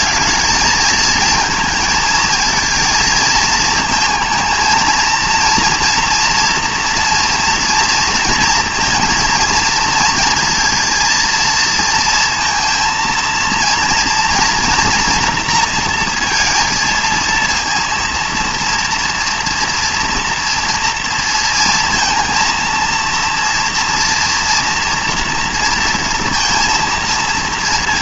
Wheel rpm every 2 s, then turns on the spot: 220, 220, 230, 230, 220, 230, 230, 230, 230, 230, 230, 230, 230, 230.
none